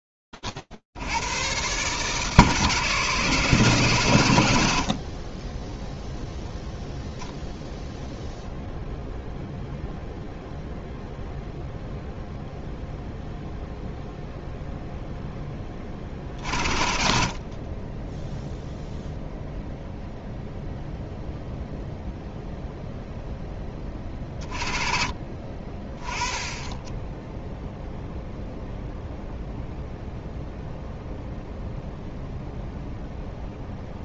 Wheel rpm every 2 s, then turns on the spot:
0, 0, 0, 0, 110, 110, 0, 0, 0, 30, 0, 0, 40, 10, 0, 0, 0.
none